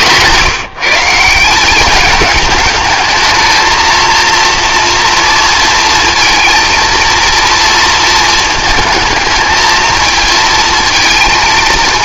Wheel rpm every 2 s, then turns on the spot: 160, 220, 230, 230, 220, 230.
none